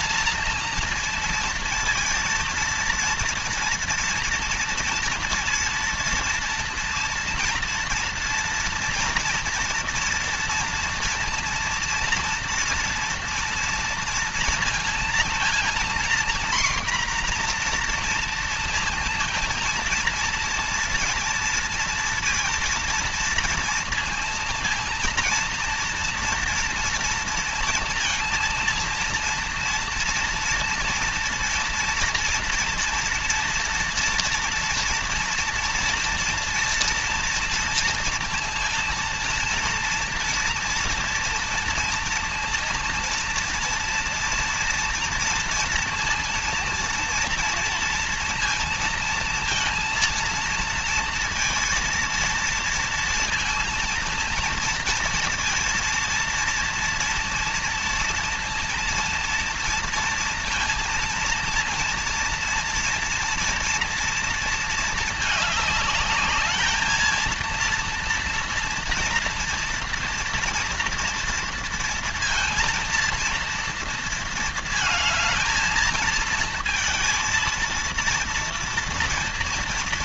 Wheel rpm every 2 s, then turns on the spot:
230, 230, 230, 240, 230, 230, 230, 230, 250, 230, 230, 230, 230, 230, 230, 230, 230, 230, 230, 230, 230, 230, 230, 230, 230, 230, 230, 230, 230, 230, 230, 230, 220, 220, 230, 230, 230, 220, 220, 230.
none